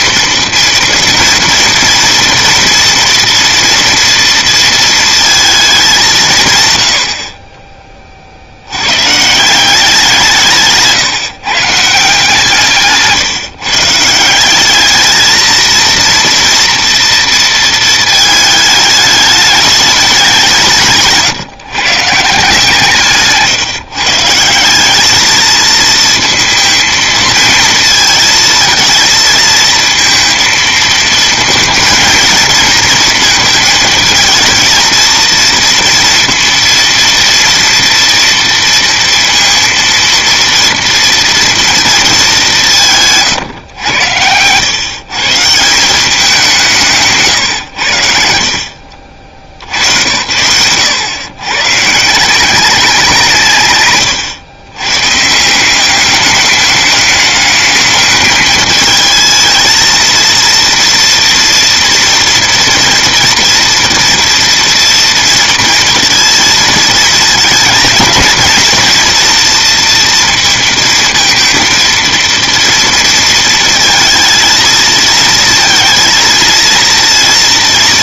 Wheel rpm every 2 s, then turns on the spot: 230, 240, 230, 120, 70, 160, 150, 200, 230, 220, 170, 150, 180, 220, 220, 220, 230, 220, 230, 230, 230, 180, 110, 180, 50, 100, 190, 120, 200, 220, 230, 230, 230, 230, 220, 230, 230, 230, 230.
none